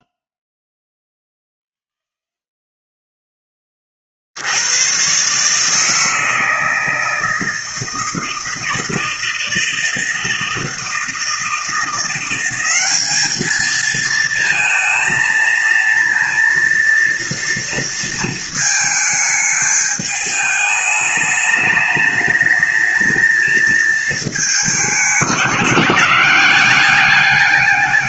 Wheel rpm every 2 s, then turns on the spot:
0, 0, 60, 160, 160, 160, 180, 220, 230, 230, 210, 210, 220, 190.
none